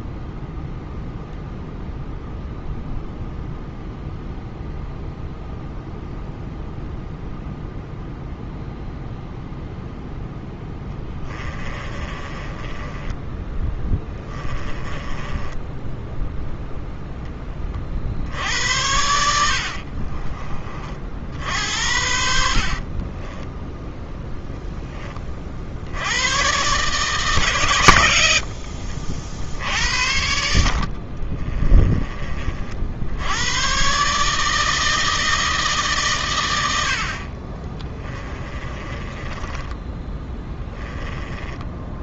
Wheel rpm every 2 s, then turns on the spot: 0, 0, 0, 0, 0, 10, 20, 30, 10, 80, 40, 40, 10, 140, 60, 50, 60, 160, 70, 30, 10.
10-16 22-24 28-32 38-40